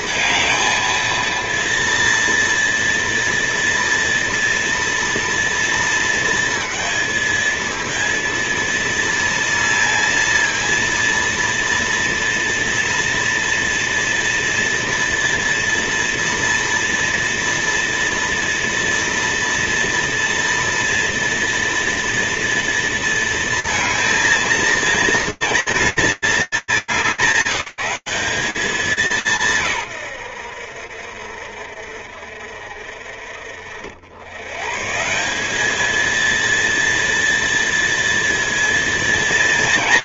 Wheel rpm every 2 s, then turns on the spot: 230, 230, 230, 230, 230, 230, 230, 230, 230, 230, 230, 230, 230, 190, 190, 70, 50, 190, 230, 230.
none